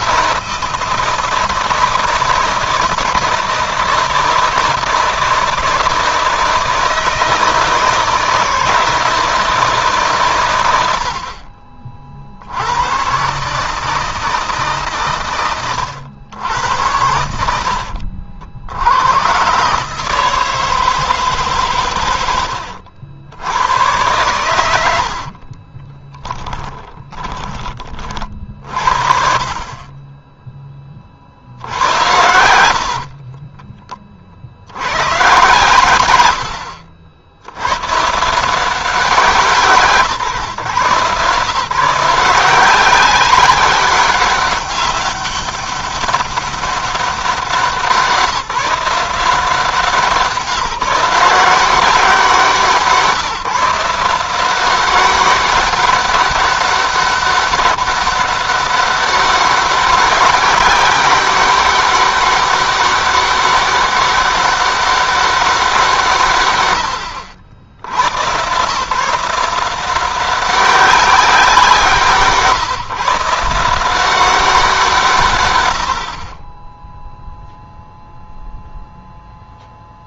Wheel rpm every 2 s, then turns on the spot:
160, 170, 170, 160, 160, 80, 110, 130, 80, 100, 160, 80, 70, 10, 40, 30, 60, 100, 70, 170, 130, 190, 200, 200, 180, 170, 170, 190, 200, 200, 200, 200, 200, 90, 150, 190, 140, 160, 10, 0.
24-26 32-34